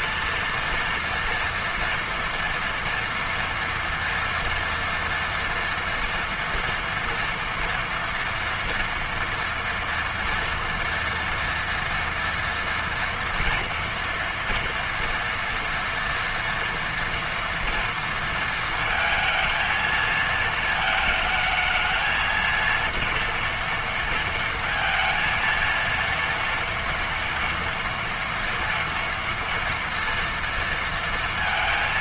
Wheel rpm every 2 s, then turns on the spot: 230, 230, 230, 230, 230, 230, 230, 230, 230, 230, 220, 230, 230, 230, 230, 230.
none